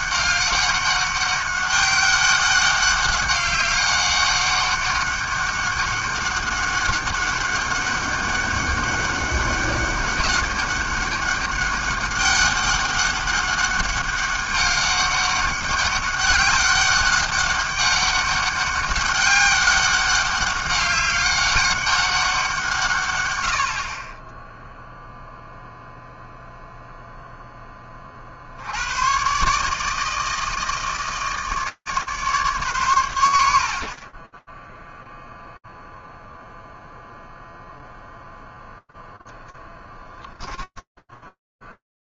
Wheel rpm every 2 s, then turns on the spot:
200, 200, 200, 200, 200, 200, 200, 200, 200, 190, 200, 100, 0, 0, 130, 160, 100, 0, 0, 10, 10.
40-42